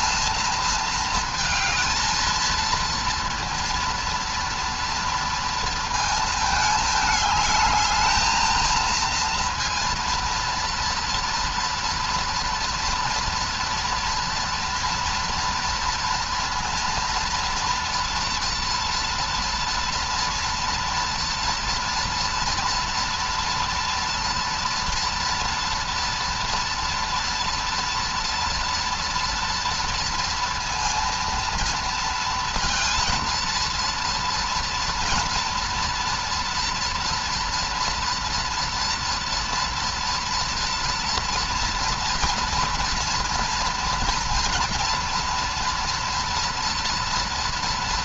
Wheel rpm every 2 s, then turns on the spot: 230, 230, 230, 210, 220, 230, 230, 230, 240, 240, 230, 230, 230, 240, 230, 230, 230, 230, 230, 240, 230, 230, 230, 230.
none